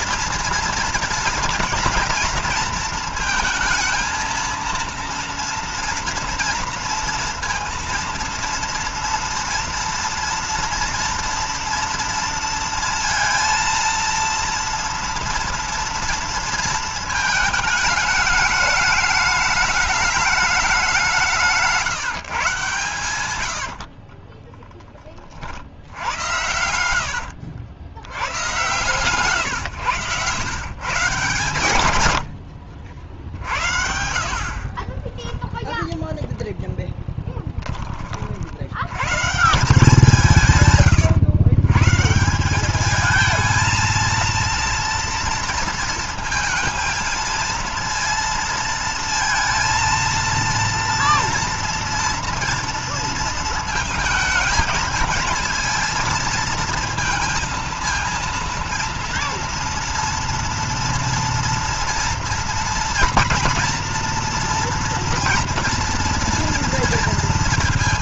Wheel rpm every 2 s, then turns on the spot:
230, 230, 230, 230, 230, 230, 230, 230, 230, 210, 200, 140, 20, 90, 130, 130, 90, 40, 0, 90, 160, 190, 230, 230, 230, 230, 230, 220, 220, 230, 230, 230, 230, 230.
32-34